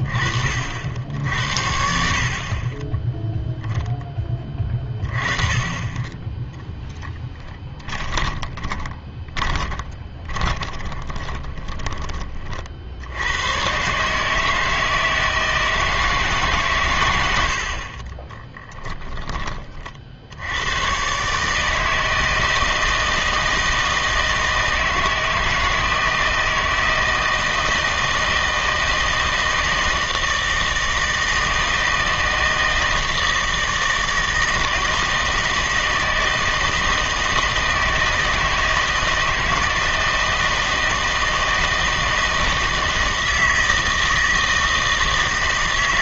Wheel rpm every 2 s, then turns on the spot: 50, 30, 20, 10, 20, 30, 50, 160, 140, 10, 100, 160, 160, 160, 160, 160, 160, 160, 160, 160, 160, 160, 160.
8-12 18-20